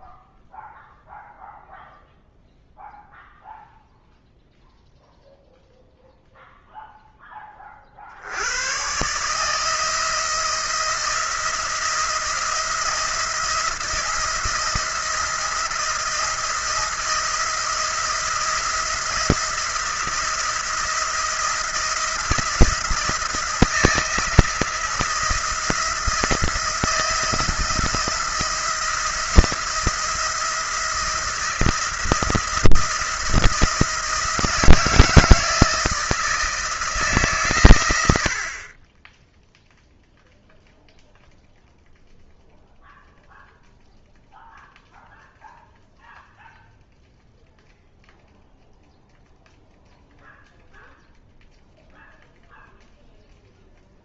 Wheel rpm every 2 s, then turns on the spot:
0, 0, 0, 0, 120, 170, 170, 170, 170, 170, 170, 160, 170, 170, 170, 170, 170, 160, 160, 20, 0, 0, 0, 0, 0, 0, 0.
none